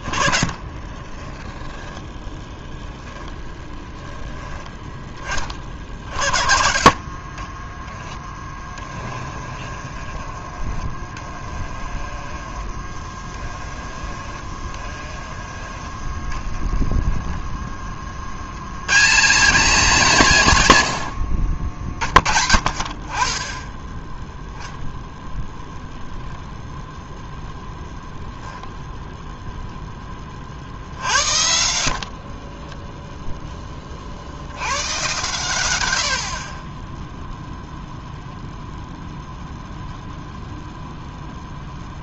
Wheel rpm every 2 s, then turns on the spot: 10, 0, 10, 50, 20, 10, 10, 10, 10, 160, 90, 40, 0, 0, 0, 50, 20, 100, 30, 0, 0.
0-2 8-10 16-18 32-34